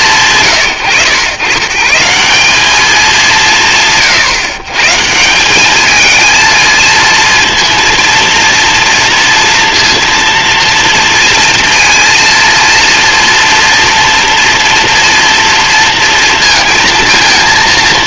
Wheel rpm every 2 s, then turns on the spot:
130, 200, 140, 230, 230, 230, 230, 230, 230.
none